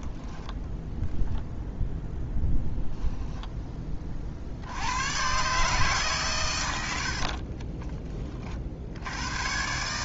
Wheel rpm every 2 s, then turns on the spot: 0, 0, 100, 80, 60.
none